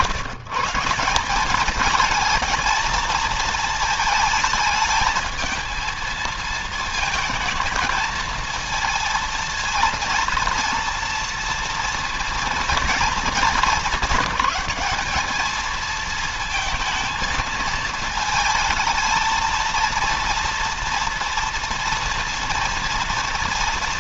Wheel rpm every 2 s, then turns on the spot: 180, 220, 220, 220, 230, 230, 230, 210, 230, 230, 230, 230.
none